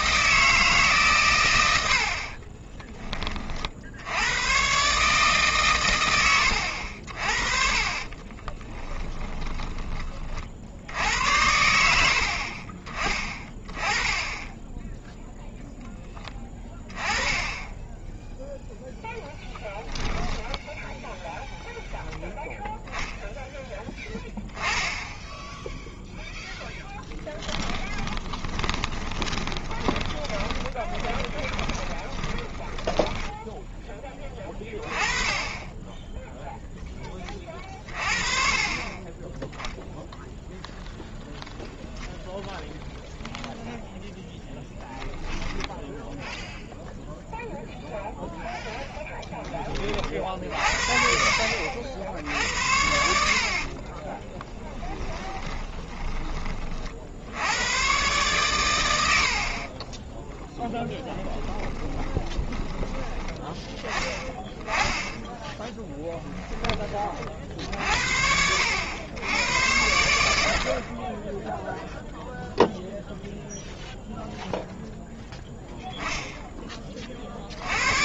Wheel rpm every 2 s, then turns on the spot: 140, 20, 140, 70, 20, 70, 30, 10, 10, 0, 0, 0, 10, 10, 30, 20, 20, 20, 0, 30, 0, 0, 0, 0, 0, 60, 70, 10, 40, 100, 20, 10, 20, 20, 80, 50, 0, 0, 20.
8-10 26-34 54-56 60-62